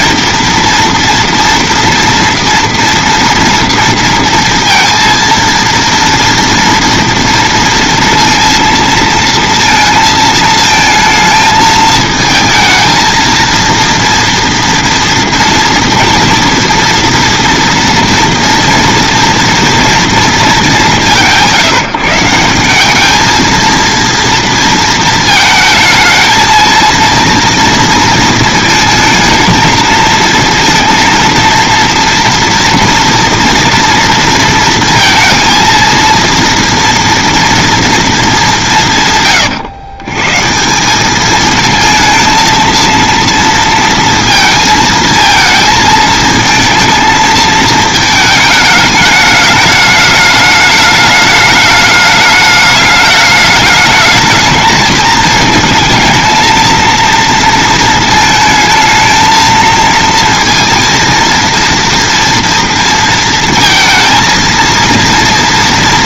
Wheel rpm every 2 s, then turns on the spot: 230, 230, 230, 240, 230, 230, 220, 240, 230, 240, 210, 190, 230, 230, 230, 230, 230, 230, 230, 190, 160, 230, 230, 220, 210, 210, 210, 210, 230, 220, 230, 230, 230.
none